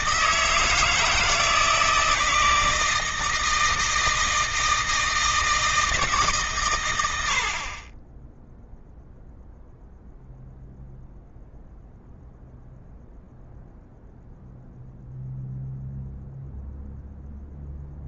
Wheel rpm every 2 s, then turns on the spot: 160, 160, 160, 120, 0, 0, 0, 0, 0.
none